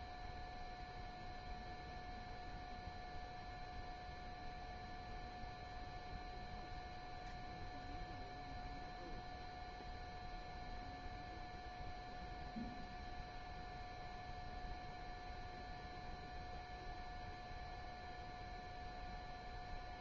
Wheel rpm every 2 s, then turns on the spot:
0, 0, 0, 0, 0, 0, 0, 0, 0, 0.
none